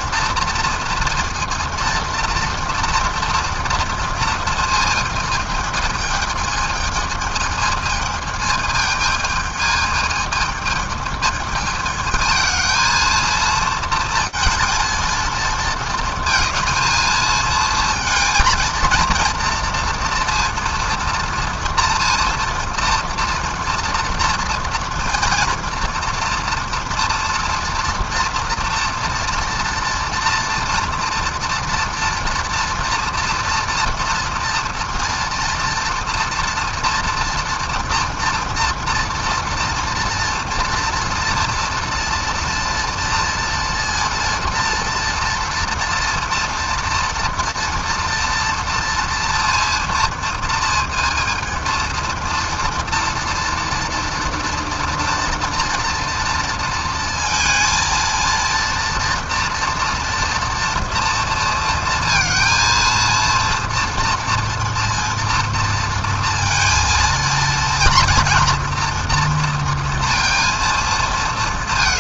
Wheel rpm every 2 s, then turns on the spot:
230, 230, 220, 220, 220, 220, 220, 230, 230, 220, 230, 230, 240, 230, 240, 230, 230, 230, 230, 230, 230, 230, 230, 230, 240, 230, 230, 230, 230, 230, 230, 230, 230, 230, 230, 230.
none